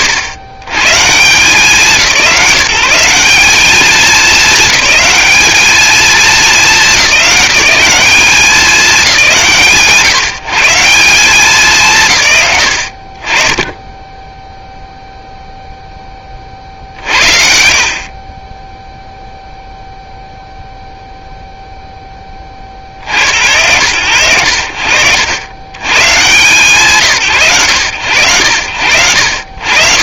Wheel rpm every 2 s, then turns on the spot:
120, 160, 210, 190, 200, 160, 60, 0, 50, 0, 0, 40, 90, 150, 80.
none